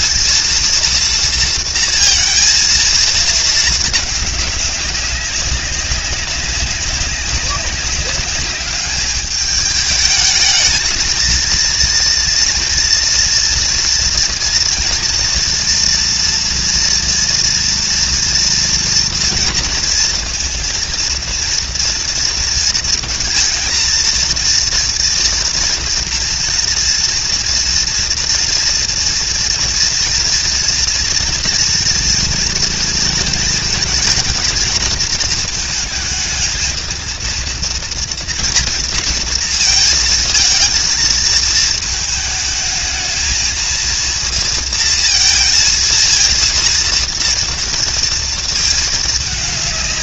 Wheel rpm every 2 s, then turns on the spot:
230, 230, 200, 190, 200, 220, 230, 230, 230, 230, 230, 230, 230, 230, 230, 240, 230, 220, 220, 230, 230, 220, 230, 230, 220.
none